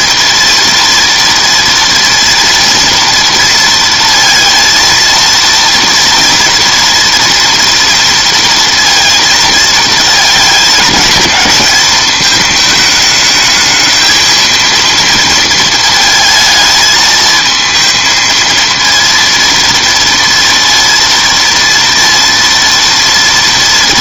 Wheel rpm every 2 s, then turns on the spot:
230, 230, 230, 230, 230, 220, 220, 230, 220, 230, 230, 230.
none